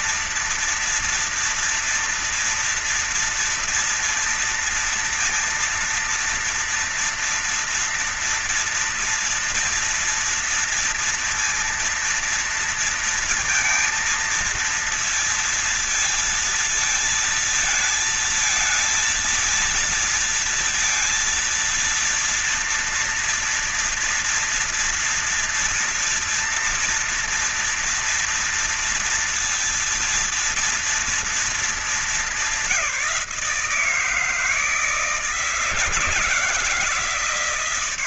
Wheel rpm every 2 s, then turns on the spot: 240, 230, 230, 230, 230, 240, 230, 230, 230, 220, 230, 230, 230, 230, 230, 230, 210, 160, 160.
none